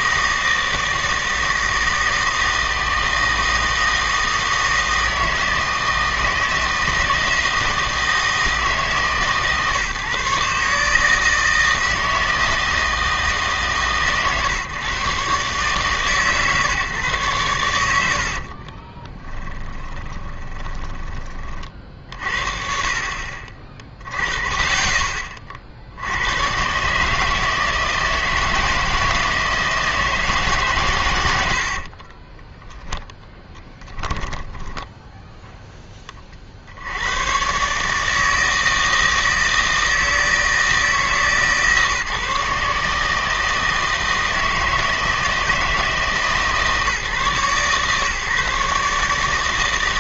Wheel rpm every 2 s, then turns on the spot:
160, 160, 160, 160, 160, 140, 160, 130, 140, 40, 20, 50, 30, 120, 160, 140, 10, 10, 60, 160, 160, 150, 160, 140, 140.
18-22 32-36